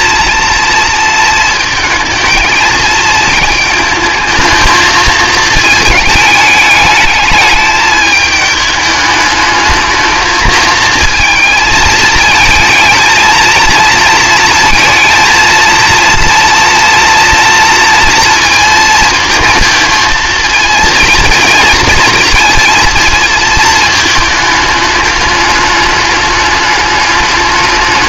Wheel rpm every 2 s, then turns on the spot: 230, 220, 220, 210, 210, 220, 220, 230, 230, 230, 230, 230, 220, 210.
none